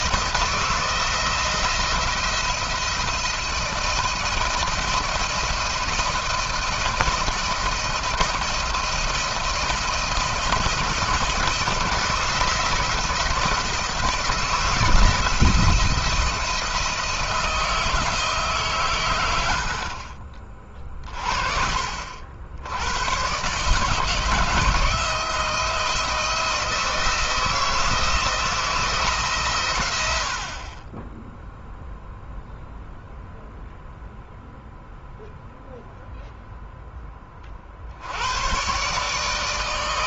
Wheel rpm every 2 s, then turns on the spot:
170, 170, 170, 160, 160, 160, 160, 160, 160, 140, 40, 90, 160, 170, 170, 40, 0, 0, 0, 120.
none